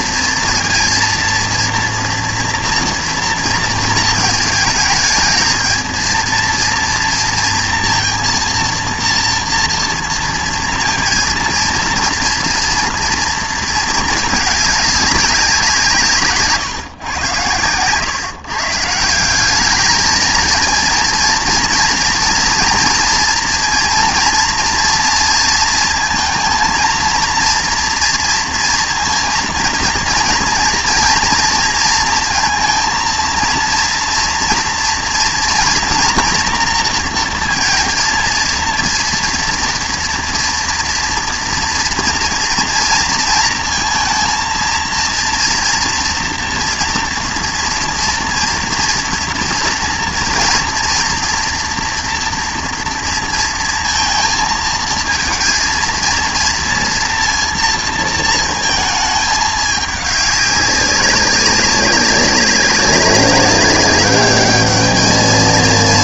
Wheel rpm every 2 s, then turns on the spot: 230, 230, 220, 230, 230, 230, 230, 210, 150, 150, 230, 230, 230, 230, 230, 230, 230, 230, 230, 230, 230, 230, 230, 230, 240, 230, 230, 230, 230, 220, 200, 190, 210.
none